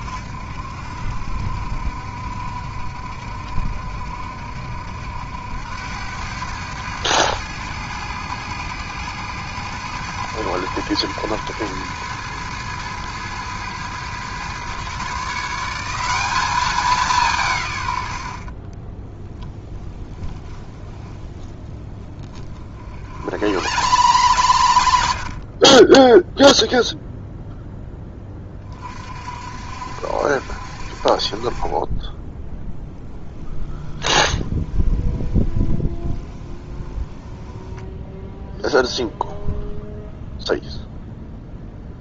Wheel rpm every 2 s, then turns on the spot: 60, 60, 70, 110, 110, 110, 110, 130, 190, 10, 20, 50, 60, 0, 40, 50, 10, 10, 10, 0, 0.
18-24 34-38